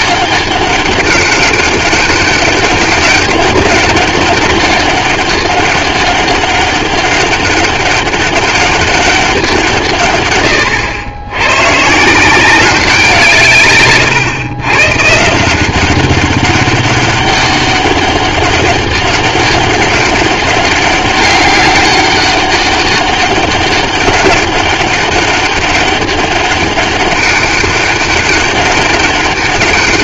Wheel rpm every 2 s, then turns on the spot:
200, 200, 200, 200, 200, 110, 190, 120, 200, 200, 200, 200, 200, 200, 200.
none